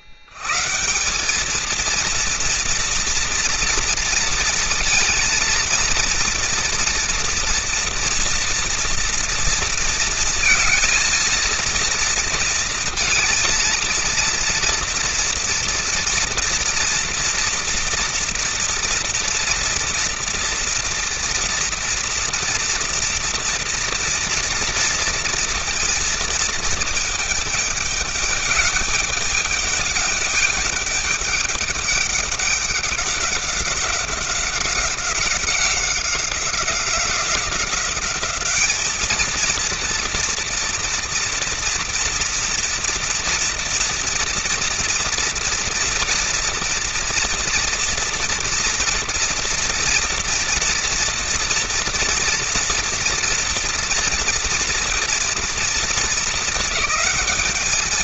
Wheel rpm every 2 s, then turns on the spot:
110, 230, 230, 230, 230, 230, 230, 230, 230, 230, 230, 230, 240, 220, 210, 210, 200, 190, 190, 210, 230, 230, 230, 230, 230, 230, 240, 230, 220.
none